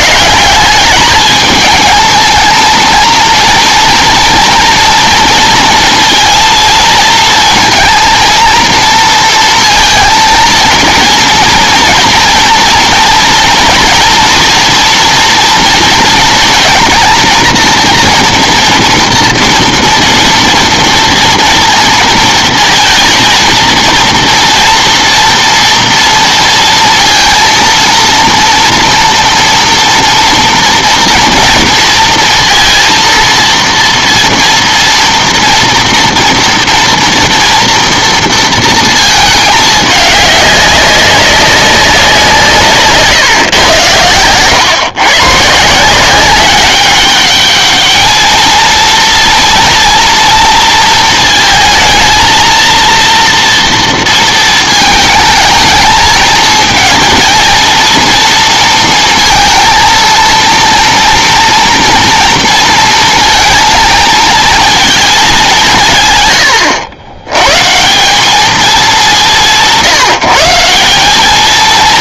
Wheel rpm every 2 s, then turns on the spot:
200, 230, 230, 230, 230, 230, 230, 230, 230, 230, 240, 220, 230, 230, 230, 230, 230, 230, 230, 230, 200, 150, 120, 190, 230, 230, 230, 220, 220, 230, 230, 230, 220, 90, 210, 180.
42-44